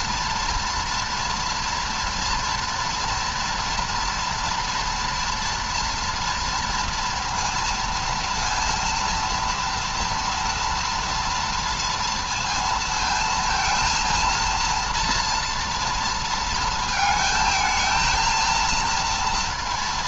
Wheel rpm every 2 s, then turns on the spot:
240, 230, 230, 230, 230, 230, 230, 230, 220, 230.
none